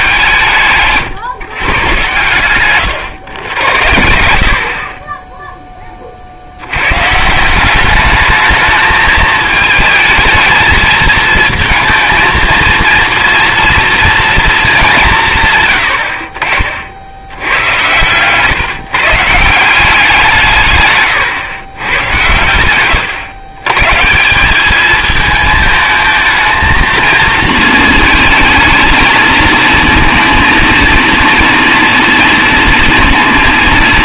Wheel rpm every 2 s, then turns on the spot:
160, 130, 40, 100, 210, 220, 230, 220, 50, 140, 140, 110, 210, 230, 220, 230, 230.
none